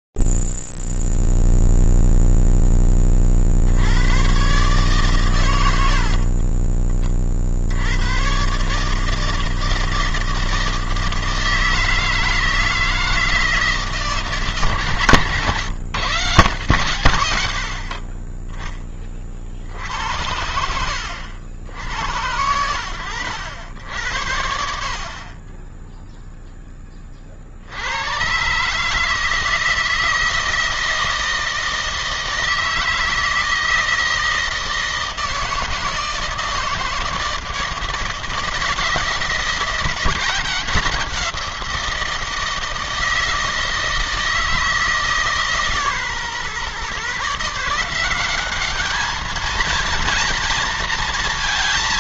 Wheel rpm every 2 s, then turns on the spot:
0, 0, 80, 80, 100, 160, 160, 160, 150, 20, 60, 100, 70, 0, 130, 160, 160, 160, 160, 170, 180, 160, 160, 130, 200, 230.
6-8